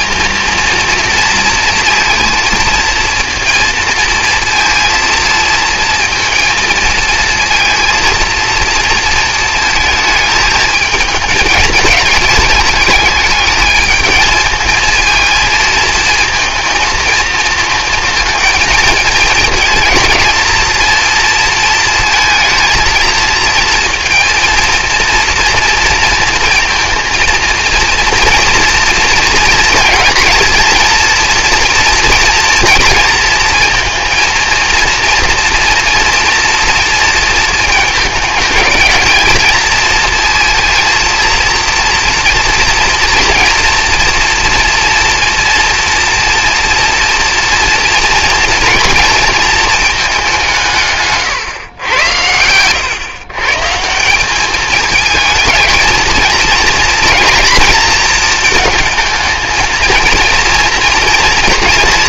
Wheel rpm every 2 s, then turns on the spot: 230, 230, 230, 230, 230, 220, 210, 220, 230, 220, 230, 220, 230, 230, 230, 220, 230, 230, 230, 210, 230, 230, 230, 230, 230, 170, 100, 210, 230, 220, 230.
none